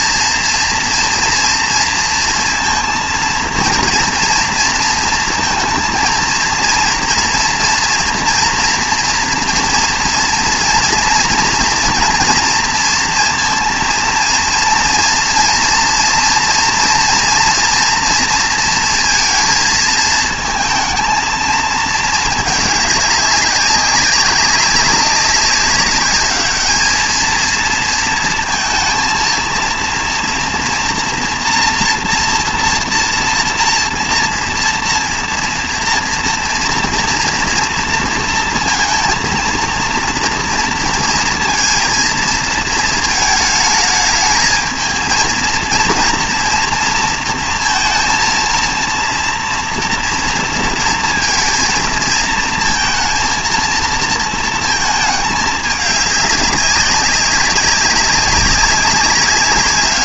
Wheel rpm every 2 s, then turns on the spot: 230, 230, 230, 230, 230, 230, 230, 230, 230, 230, 220, 210, 200, 210, 220, 230, 240, 230, 230, 230, 230, 230, 220, 230, 230, 230, 230, 230, 200, 200.
none